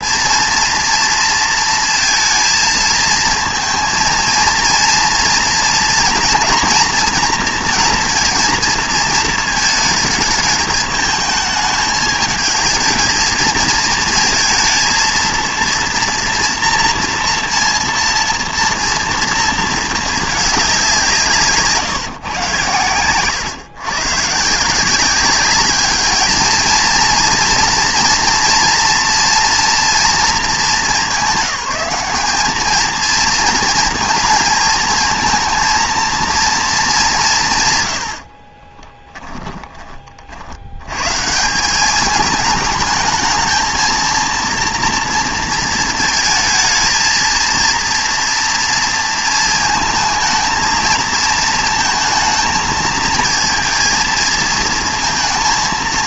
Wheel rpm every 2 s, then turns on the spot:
230, 220, 230, 230, 230, 210, 220, 230, 230, 230, 190, 100, 180, 230, 230, 200, 220, 220, 210, 20, 100, 210, 240, 230, 230, 220, 220, 230.
38-40